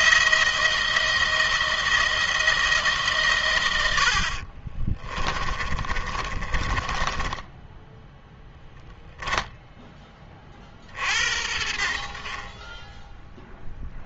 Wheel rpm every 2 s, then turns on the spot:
170, 150, 40, 20, 10, 50, 20.
4-8